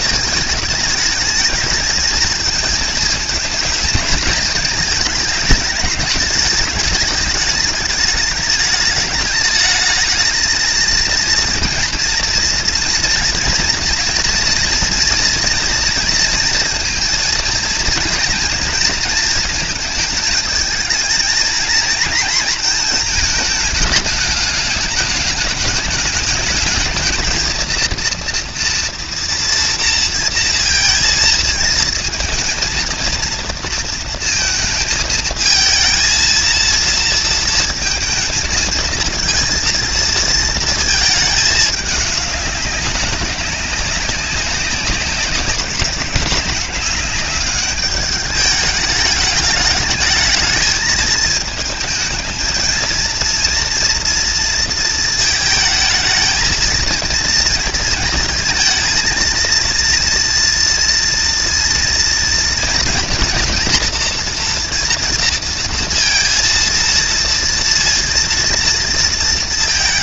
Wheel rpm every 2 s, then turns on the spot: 220, 220, 220, 210, 210, 220, 230, 240, 230, 230, 220, 230, 210, 220, 230, 230, 220, 230, 230, 220, 220, 200, 190, 190, 210, 220, 220, 230, 220, 230, 230, 230, 240, 230, 230.
none